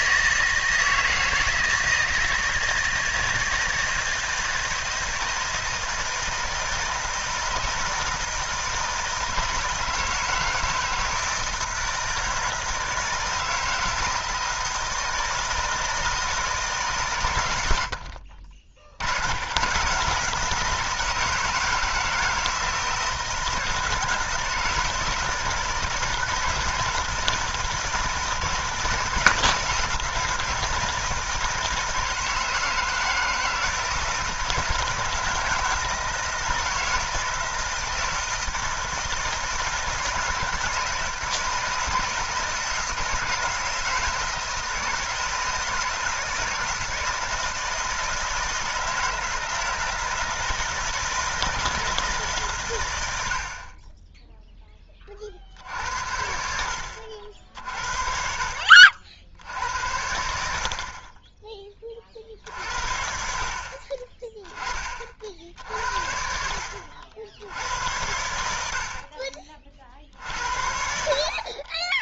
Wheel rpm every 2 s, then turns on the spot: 160, 160, 160, 160, 160, 160, 160, 160, 160, 70, 160, 160, 160, 160, 160, 160, 160, 160, 160, 160, 160, 160, 160, 160, 160, 160, 120, 10, 70, 50, 70, 50, 20, 70, 80, 70.
none